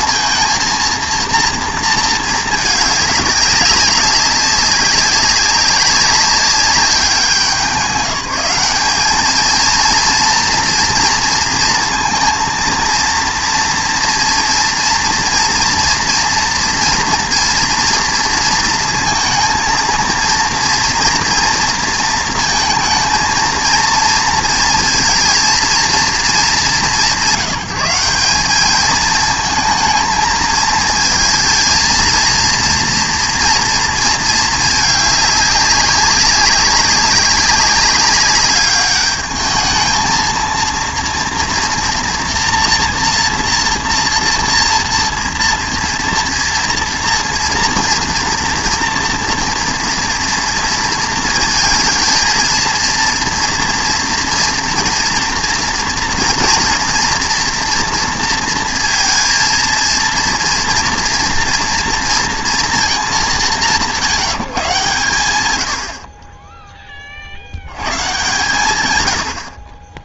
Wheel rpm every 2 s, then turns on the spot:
230, 210, 200, 190, 200, 230, 230, 230, 230, 230, 230, 230, 230, 190, 210, 220, 230, 220, 190, 200, 230, 240, 230, 230, 230, 230, 230, 240, 230, 230, 230, 230, 150, 10, 120.
none